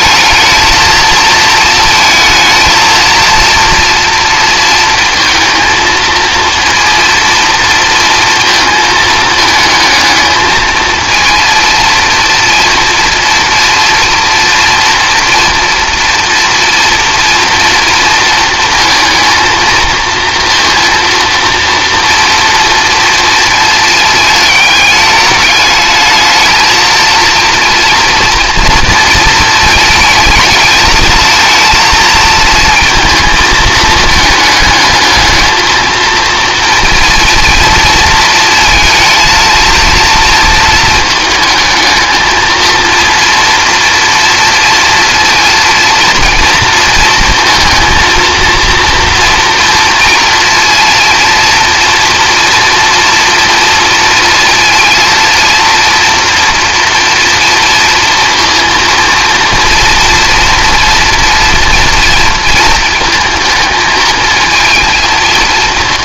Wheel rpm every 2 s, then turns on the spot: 220, 230, 230, 230, 220, 220, 230, 230, 240, 220, 230, 230, 210, 220, 230, 220, 220, 220, 230, 230, 220, 230, 230, 220, 230, 230, 230, 230, 230, 230, 230, 230, 220.
none